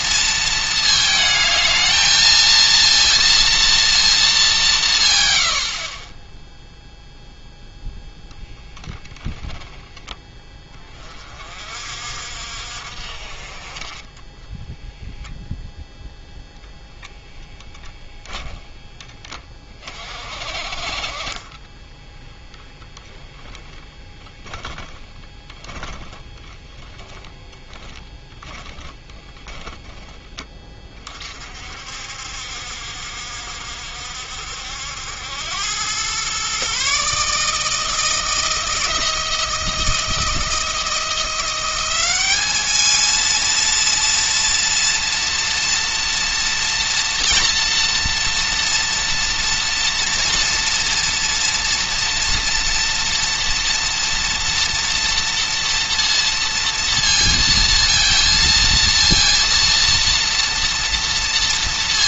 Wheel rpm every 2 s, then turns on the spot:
220, 230, 180, 0, 0, 20, 50, 0, 0, 10, 50, 0, 10, 10, 10, 30, 60, 70, 130, 170, 170, 220, 230, 230, 230, 230, 230, 230, 230, 230, 230.
24-30